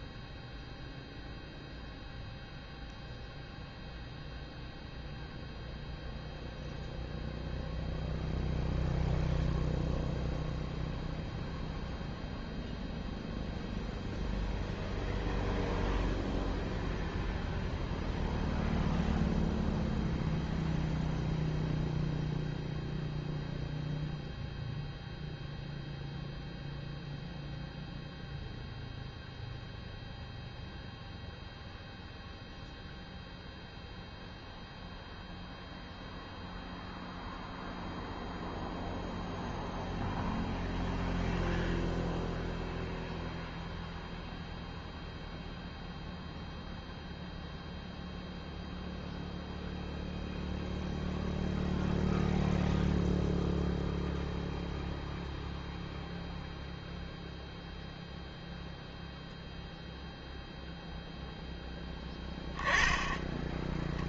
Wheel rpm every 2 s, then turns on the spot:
0, 0, 0, 0, 0, 0, 0, 0, 0, 0, 0, 0, 0, 0, 0, 0, 0, 0, 0, 0, 0, 0, 0, 0, 0, 0, 0, 0, 0, 0, 0, 10.
none